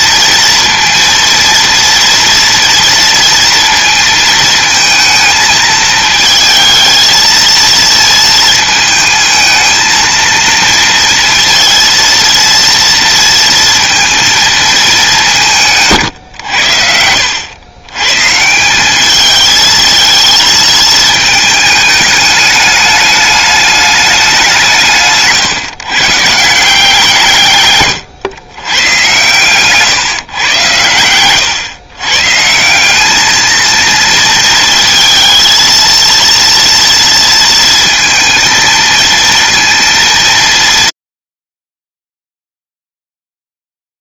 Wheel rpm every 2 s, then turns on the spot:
230, 230, 220, 220, 220, 230, 230, 190, 90, 200, 220, 210, 140, 160, 120, 110, 210, 230, 230, 230, 130, 0.
none